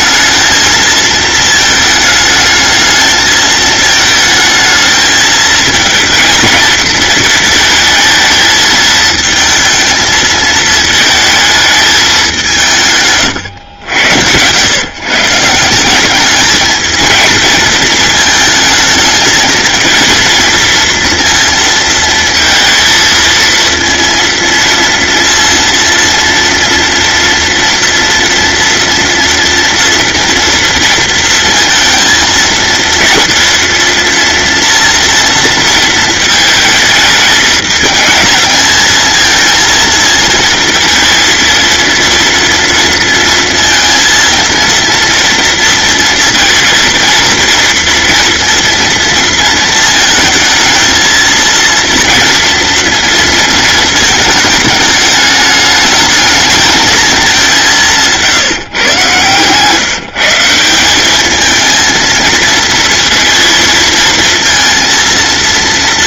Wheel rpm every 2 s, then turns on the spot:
220, 220, 220, 220, 220, 220, 180, 110, 220, 220, 230, 230, 230, 230, 230, 230, 230, 240, 220, 220, 230, 230, 230, 230, 230, 220, 230, 210, 220, 150, 180, 230, 230.
none